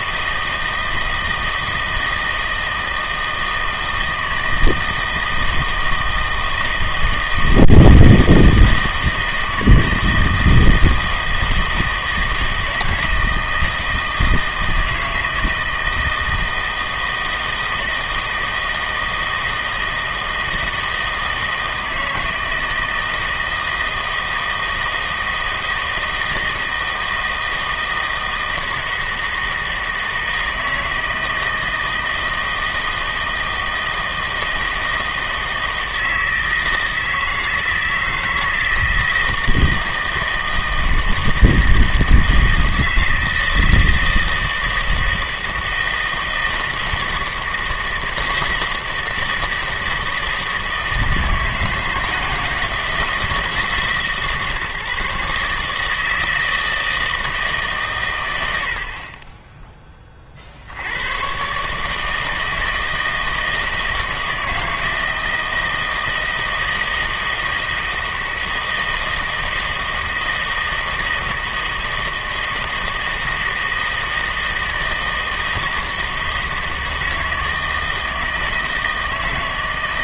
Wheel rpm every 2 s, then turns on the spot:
160, 160, 160, 160, 160, 160, 160, 160, 160, 160, 160, 160, 160, 160, 160, 160, 160, 160, 160, 160, 160, 160, 160, 160, 160, 160, 170, 150, 160, 60, 70, 160, 160, 160, 160, 160, 160, 160, 160, 160.
none